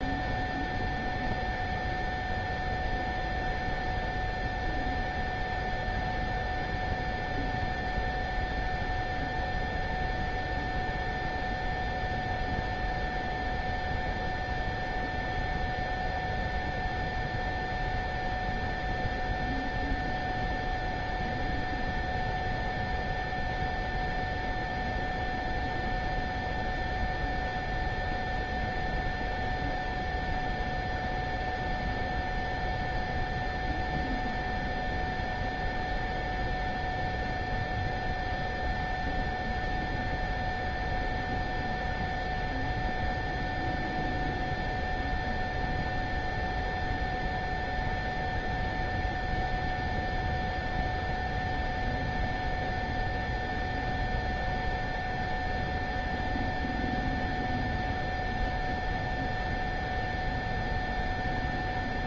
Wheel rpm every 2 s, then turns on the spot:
0, 0, 0, 0, 0, 0, 0, 0, 0, 0, 0, 0, 0, 0, 0, 0, 0, 0, 0, 0, 0, 0, 0, 0, 0, 0, 0, 0, 0, 0, 0.
none